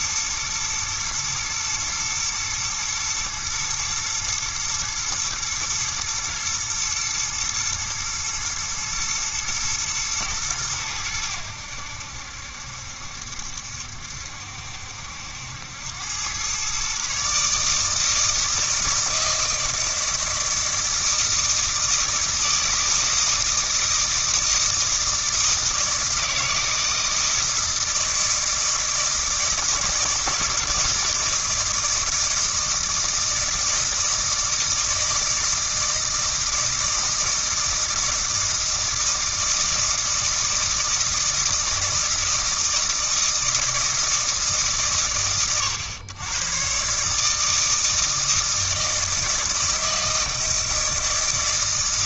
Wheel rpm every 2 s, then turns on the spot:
120, 120, 110, 120, 120, 100, 70, 70, 130, 160, 160, 160, 160, 160, 160, 160, 160, 160, 160, 160, 160, 160, 130, 130, 160, 160.
none